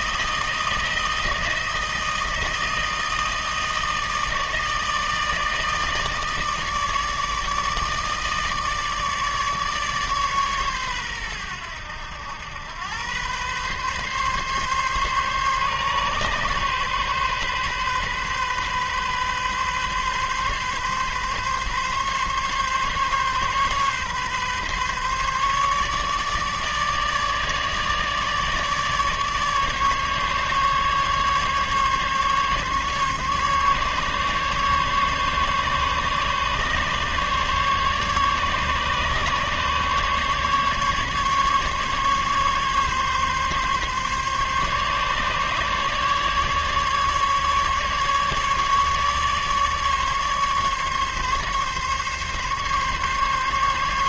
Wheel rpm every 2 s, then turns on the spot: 160, 160, 160, 160, 150, 130, 100, 140, 140, 130, 130, 140, 140, 150, 150, 150, 140, 140, 140, 140, 140, 140, 140, 150, 150, 140, 140.
none